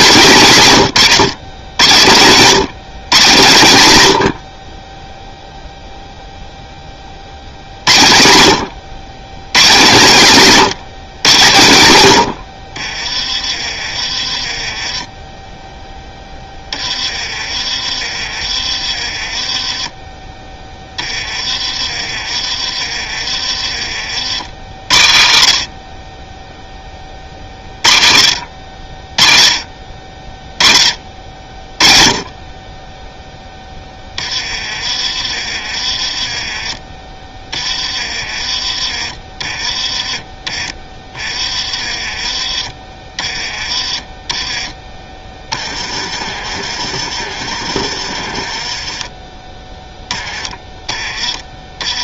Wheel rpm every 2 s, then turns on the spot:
160, 150, 30, 30, 90, 170, 50, 20, 20, 30, 10, 30, 50, 20, 50, 20, 20, 20, 20, 30, 20, 20, 10, 40, 30, 10.
46-50